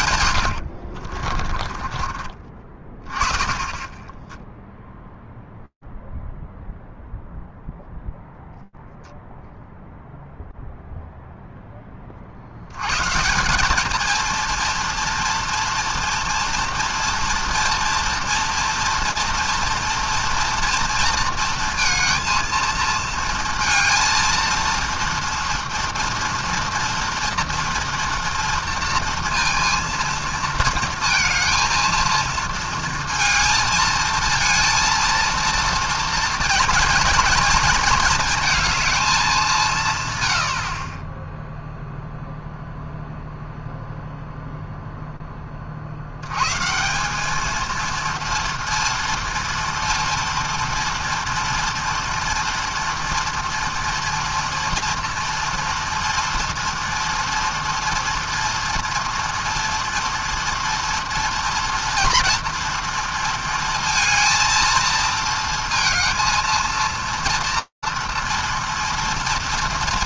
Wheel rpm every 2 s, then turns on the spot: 80, 30, 0, 0, 0, 0, 80, 230, 240, 240, 230, 230, 230, 230, 230, 230, 230, 230, 230, 220, 80, 0, 0, 130, 230, 240, 230, 230, 230, 240, 230, 230, 230, 230, 230.
0-2